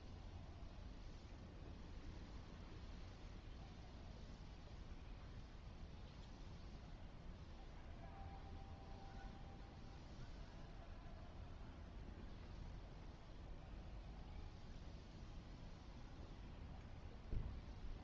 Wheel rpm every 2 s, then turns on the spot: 0, 0, 0, 0, 0, 0, 0, 0, 0.
none